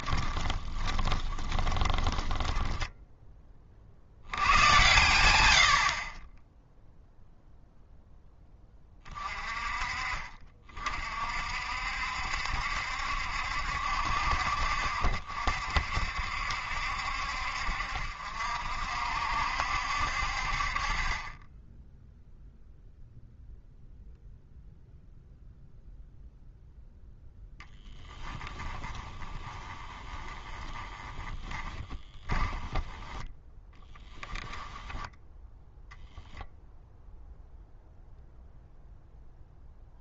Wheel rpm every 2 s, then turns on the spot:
20, 10, 100, 0, 20, 40, 70, 50, 60, 60, 40, 0, 0, 0, 20, 20, 10, 10, 0, 0.
0-2 28-32 34-36